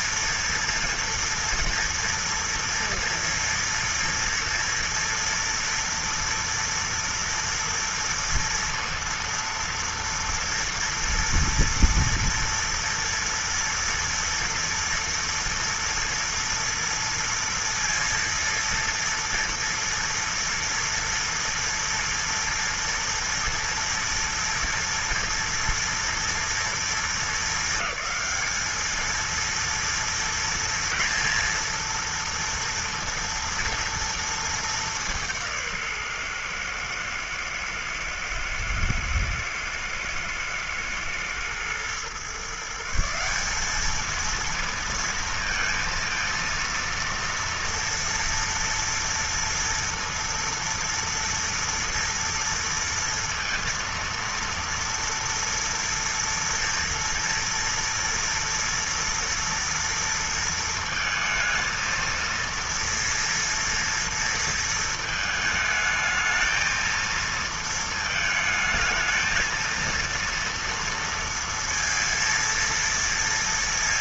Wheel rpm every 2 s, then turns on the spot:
230, 240, 230, 230, 230, 230, 230, 230, 230, 230, 230, 230, 230, 230, 210, 230, 230, 230, 140, 110, 110, 130, 220, 230, 230, 230, 230, 230, 230, 230, 230, 230, 230, 220, 220, 230, 230.
none